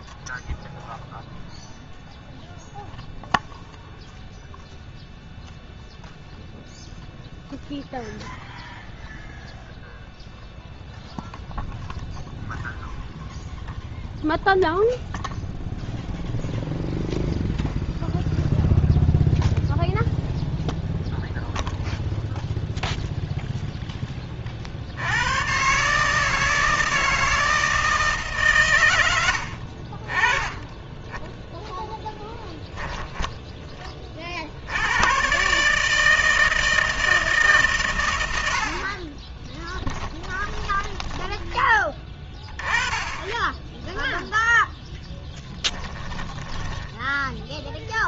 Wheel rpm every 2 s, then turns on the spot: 0, 0, 0, 0, 0, 0, 0, 0, 0, 0, 0, 0, 120, 160, 80, 10, 50, 160, 130, 20, 20, 10, 20, 10.
32-34 38-40 42-46